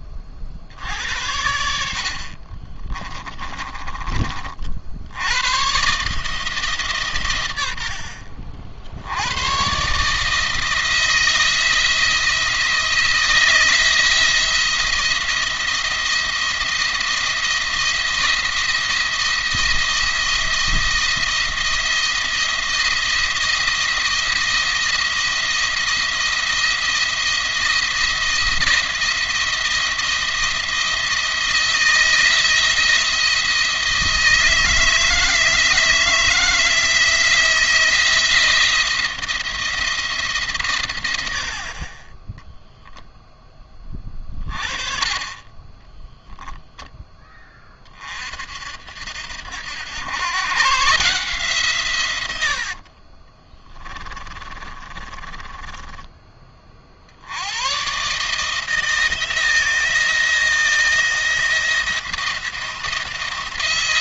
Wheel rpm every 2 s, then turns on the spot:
50, 30, 50, 150, 50, 160, 170, 170, 170, 170, 170, 170, 170, 170, 170, 170, 170, 160, 170, 170, 130, 0, 30, 0, 60, 120, 90, 30, 30, 150, 170, 170.
2-4 52-56